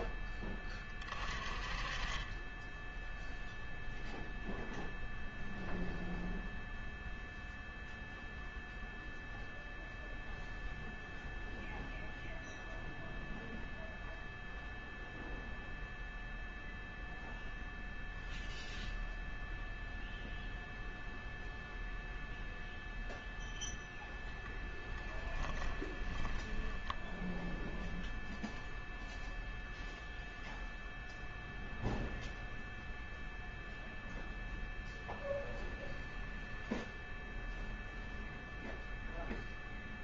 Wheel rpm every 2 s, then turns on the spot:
30, 10, 0, 0, 0, 0, 0, 0, 0, 0, 0, 0, 20, 10, 0, 0, 0, 0, 10, 0.
24-26